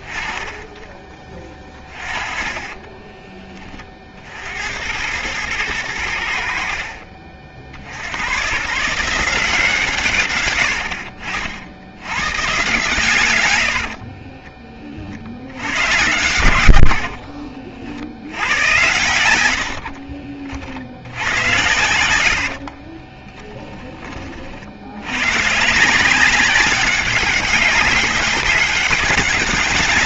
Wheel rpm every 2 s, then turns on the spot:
10, 20, 70, 70, 120, 110, 120, 30, 80, 90, 40, 60, 60, 190, 200.
2-4 22-24